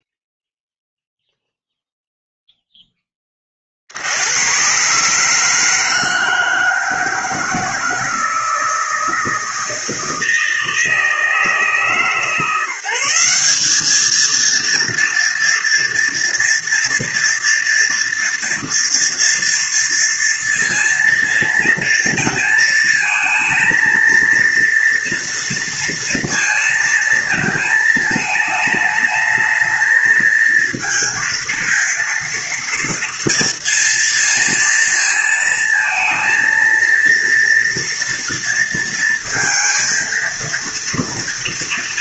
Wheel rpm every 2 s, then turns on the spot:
0, 0, 100, 160, 160, 160, 160, 220, 230, 240, 230, 230, 230, 230, 220, 220, 230, 230, 230, 230, 230.
none